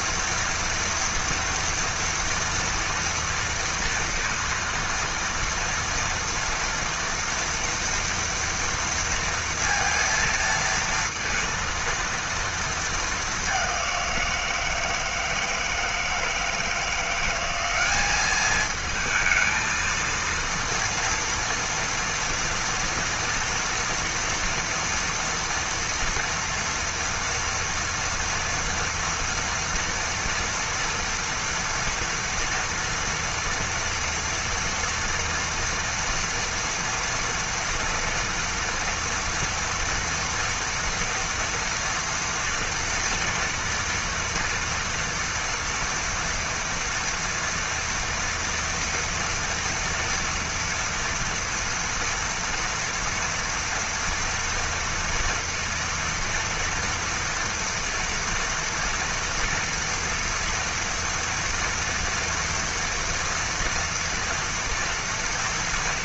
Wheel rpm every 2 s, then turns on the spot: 230, 230, 230, 230, 230, 230, 230, 180, 160, 200, 230, 230, 230, 230, 230, 230, 230, 230, 230, 230, 230, 230, 230, 240, 230, 230, 230, 230, 240, 240, 230, 230, 240.
none